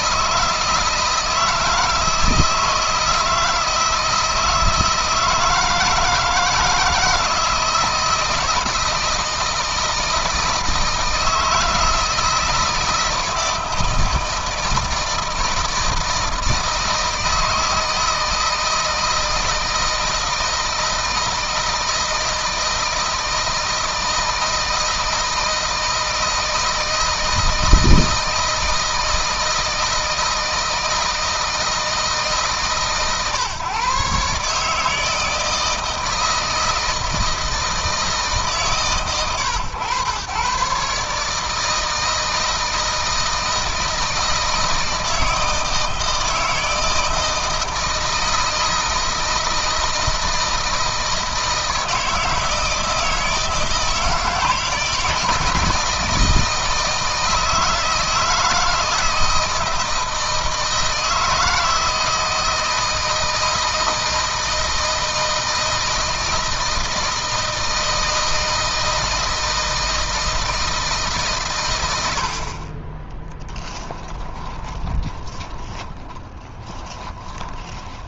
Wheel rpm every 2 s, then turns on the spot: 160, 160, 160, 160, 160, 160, 160, 160, 160, 160, 160, 160, 160, 160, 160, 160, 140, 150, 160, 130, 140, 160, 160, 160, 160, 160, 160, 150, 160, 160, 160, 160, 160, 160, 160, 150, 40, 20, 20.
72-78